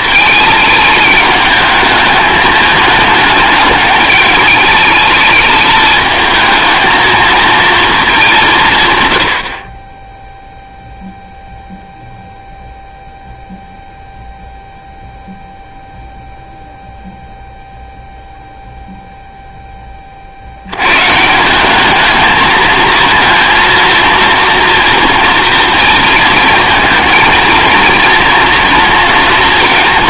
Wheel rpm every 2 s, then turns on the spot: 210, 210, 210, 220, 150, 0, 0, 0, 0, 0, 90, 220, 230, 220, 230.
none